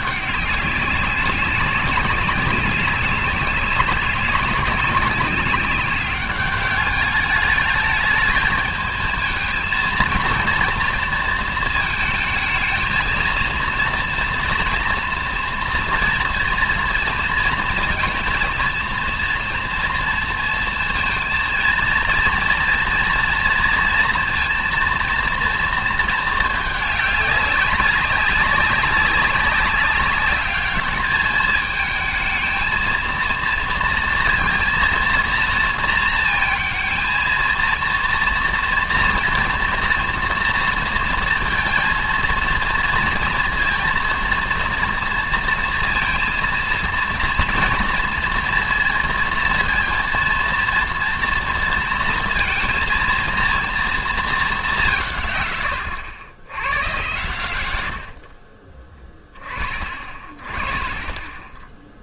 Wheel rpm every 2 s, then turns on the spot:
200, 200, 190, 200, 220, 230, 230, 240, 230, 230, 230, 230, 230, 210, 190, 210, 220, 230, 220, 230, 230, 230, 230, 230, 230, 230, 230, 180, 100, 30, 20.
none